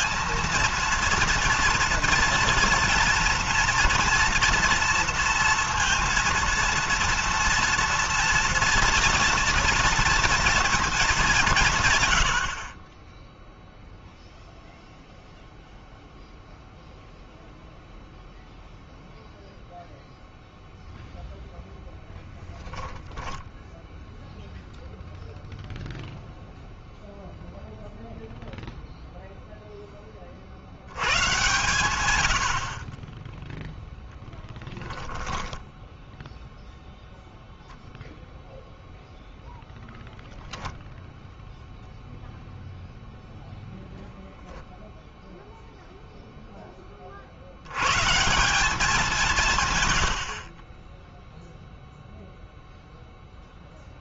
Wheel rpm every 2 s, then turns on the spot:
230, 230, 230, 230, 230, 230, 90, 0, 0, 0, 0, 10, 0, 0, 0, 60, 80, 10, 0, 0, 0, 0, 0, 10, 180, 30, 0.
50-52